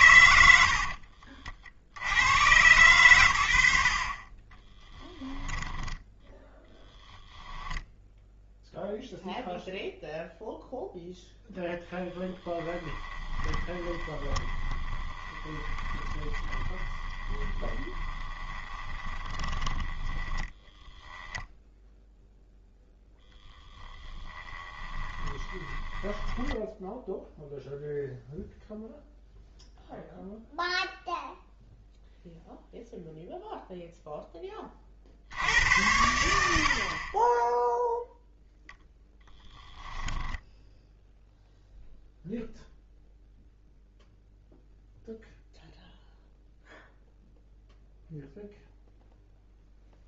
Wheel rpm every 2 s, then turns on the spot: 90, 100, 20, 10, 0, 0, 20, 20, 20, 20, 10, 10, 30, 10, 0, 0, 0, 30, 50, 10, 10, 0, 0, 0, 0.
4-6 12-22 24-28 38-40